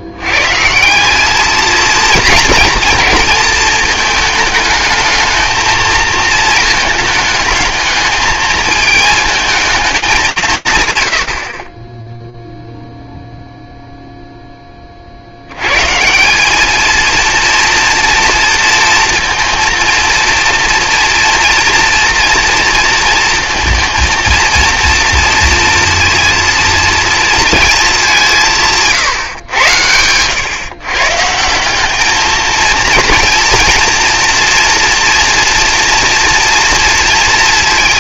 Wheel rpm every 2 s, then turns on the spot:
160, 230, 220, 220, 220, 140, 0, 10, 210, 230, 230, 230, 230, 230, 150, 140, 230, 240, 230.
none